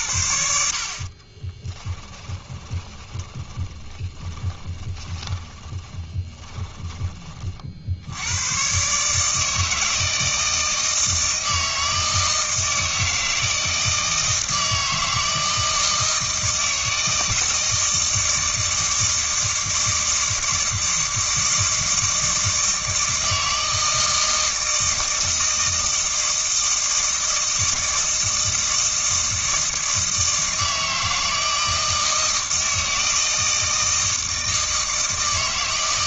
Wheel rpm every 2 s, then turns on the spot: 50, 20, 30, 20, 130, 160, 160, 160, 160, 160, 160, 160, 160, 160, 160, 160, 160, 160.
0-6